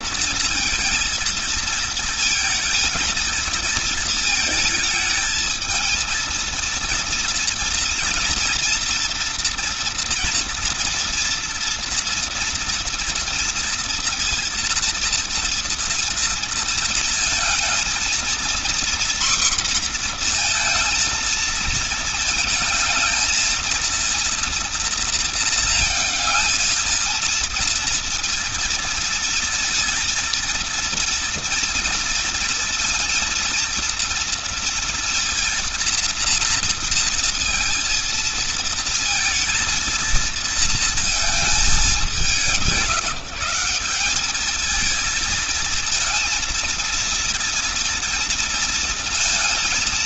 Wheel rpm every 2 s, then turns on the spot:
230, 220, 220, 230, 240, 240, 230, 230, 230, 240, 230, 220, 230, 230, 230, 230, 230, 230, 230, 230, 230, 170, 220, 230, 230.
none